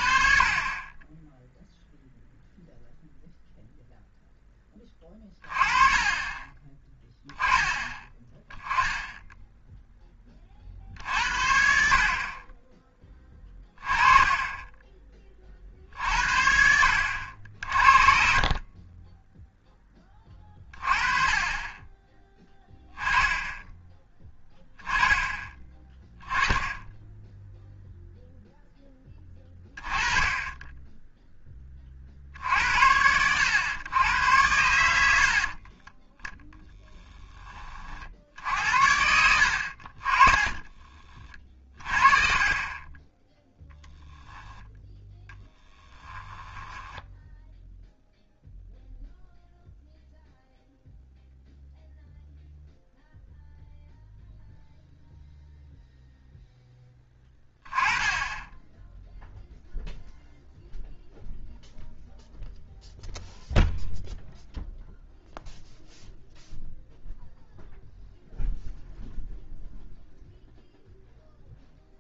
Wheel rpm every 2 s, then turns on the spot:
30, 0, 20, 10, 10, 50, 20, 20, 70, 30, 30, 10, 10, 10, 10, 10, 70, 90, 10, 70, 30, 20, 0, 10, 0, 0, 0, 0, 10, 10, 0, 0, 0, 0, 0, 0.
40-42 46-48